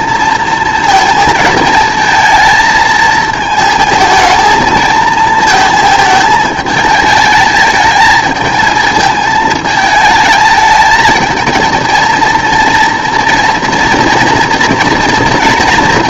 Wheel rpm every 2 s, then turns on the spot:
230, 220, 230, 220, 220, 220, 230, 230.
none